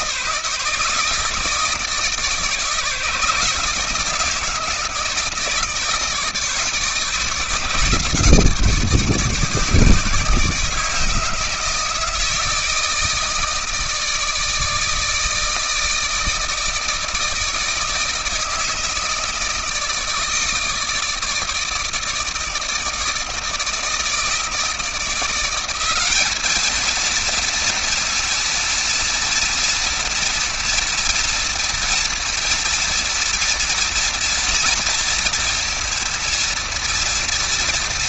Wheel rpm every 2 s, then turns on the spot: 160, 160, 160, 150, 150, 160, 160, 160, 160, 160, 160, 160, 170, 230, 240, 230, 230, 240, 230.
none